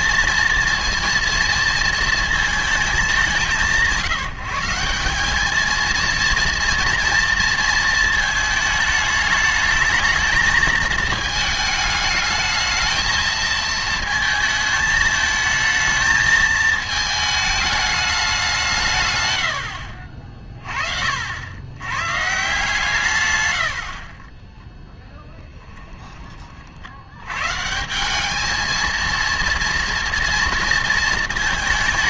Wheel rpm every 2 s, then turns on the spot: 230, 230, 180, 230, 220, 220, 220, 220, 220, 180, 40, 150, 0, 50, 220, 230.
none